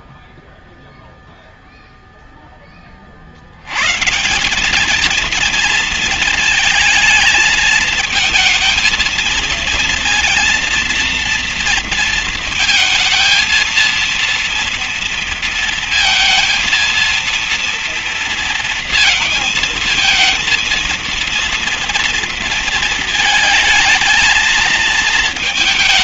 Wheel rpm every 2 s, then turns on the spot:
0, 30, 210, 220, 230, 230, 220, 230, 230, 230, 230, 230, 220.
none